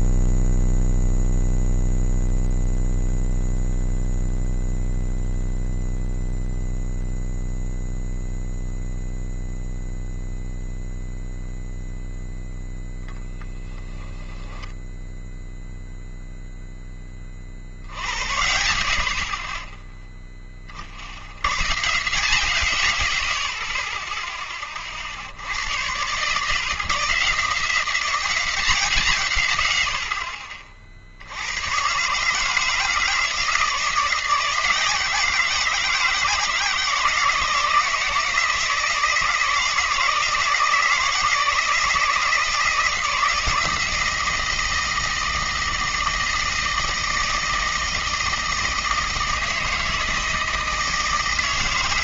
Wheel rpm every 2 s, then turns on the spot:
0, 0, 0, 0, 0, 0, 0, 10, 10, 60, 50, 40, 30, 130, 160, 50, 160, 170, 160, 160, 160, 160, 160, 160, 160, 160.
14-16